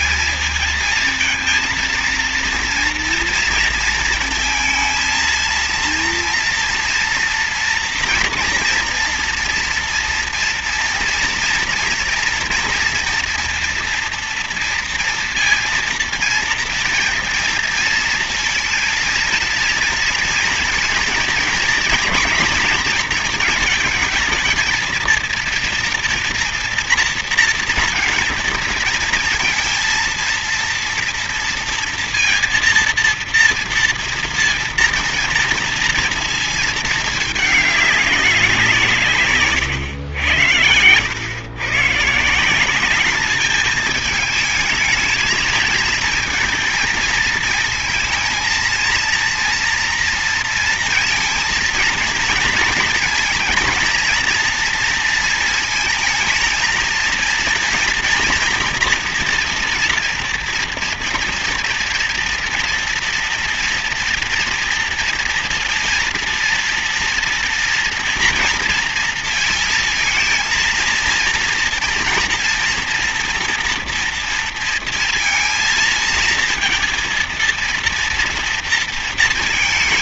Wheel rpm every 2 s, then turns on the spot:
220, 240, 230, 230, 230, 230, 230, 230, 230, 230, 230, 230, 230, 240, 230, 230, 230, 230, 220, 170, 110, 200, 220, 220, 230, 230, 240, 230, 230, 240, 230, 240, 230, 230, 230, 230, 240, 230, 230, 230.
none